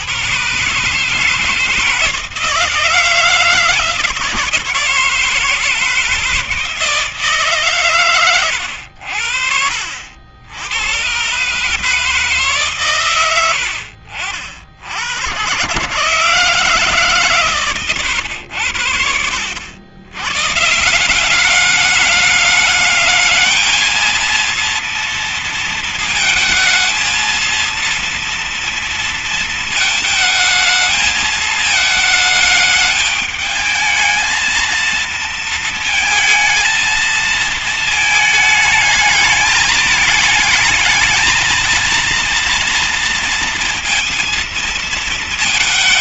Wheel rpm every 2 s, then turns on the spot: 140, 160, 160, 160, 90, 100, 130, 70, 160, 80, 140, 210, 230, 230, 230, 220, 210, 230, 220, 220, 220, 230, 220.
none